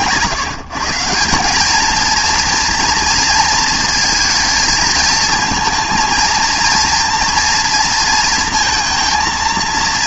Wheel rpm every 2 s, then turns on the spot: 150, 230, 230, 230, 230.
none